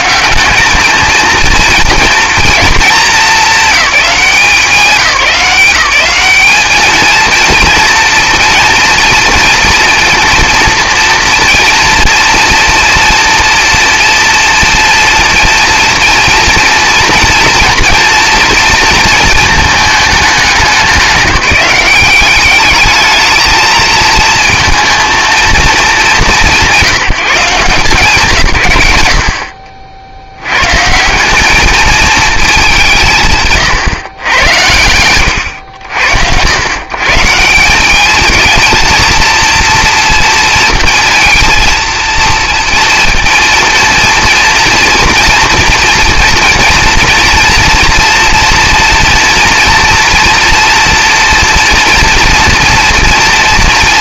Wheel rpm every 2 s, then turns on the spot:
190, 240, 200, 210, 230, 230, 230, 230, 230, 230, 200, 200, 220, 160, 130, 100, 210, 90, 100, 220, 230, 230, 230, 230, 230, 230, 240.
none